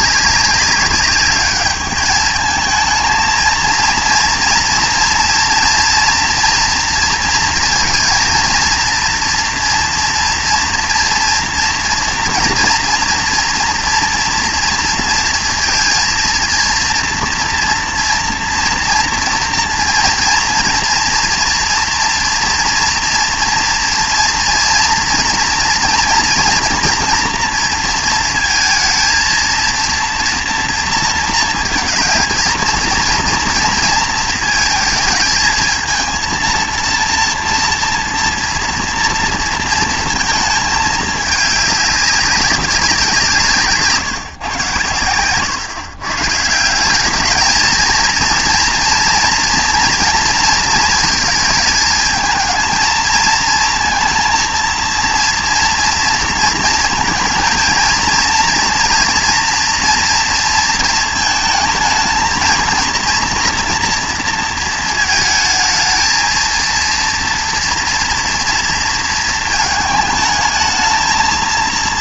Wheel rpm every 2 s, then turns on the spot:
200, 220, 230, 230, 230, 230, 230, 230, 230, 230, 230, 230, 230, 230, 230, 230, 230, 230, 230, 240, 220, 200, 120, 170, 230, 230, 220, 230, 230, 230, 230, 220, 230, 230, 230, 220.
none